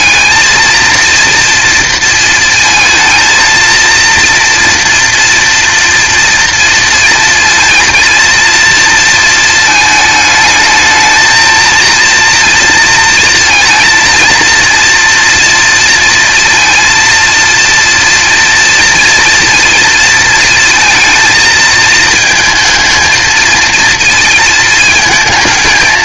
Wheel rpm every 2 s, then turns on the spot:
230, 230, 230, 230, 230, 220, 230, 230, 230, 230, 230, 220, 220.
none